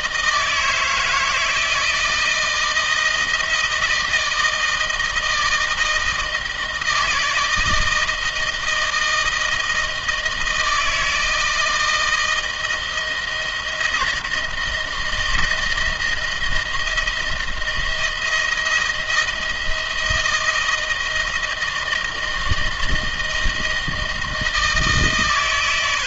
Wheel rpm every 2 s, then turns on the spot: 160, 160, 160, 160, 160, 160, 160, 160, 160, 170, 160, 160, 150.
none